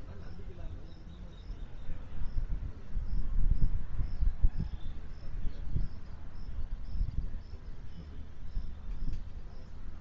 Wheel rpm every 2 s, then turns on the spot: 0, 0, 0, 0, 0.
none